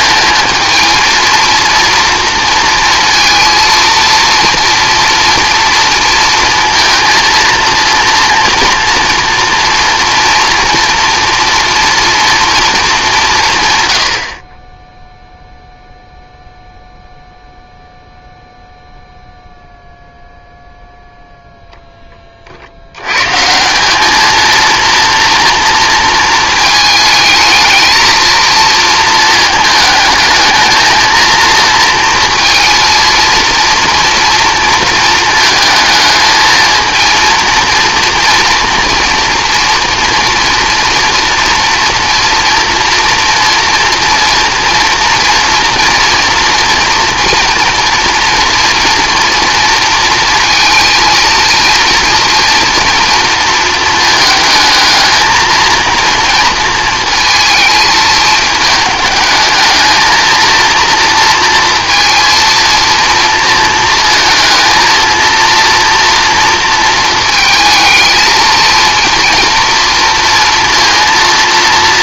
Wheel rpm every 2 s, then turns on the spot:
230, 230, 230, 230, 240, 240, 210, 10, 0, 0, 0, 80, 230, 220, 230, 220, 230, 230, 220, 230, 240, 240, 230, 240, 230, 230, 230, 220, 230, 220, 230, 230, 230, 230, 230, 230.
none